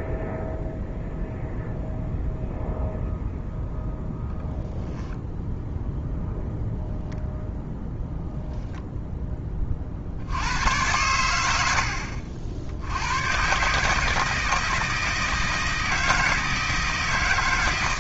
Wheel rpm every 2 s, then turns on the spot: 0, 0, 0, 0, 0, 90, 90, 160, 160.
none